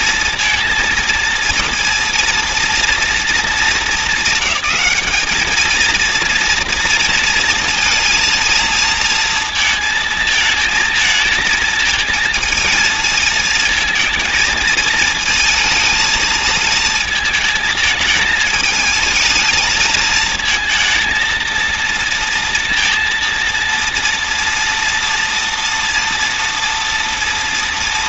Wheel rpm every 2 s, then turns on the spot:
230, 230, 200, 230, 230, 230, 220, 220, 220, 220, 230, 230, 230, 230.
none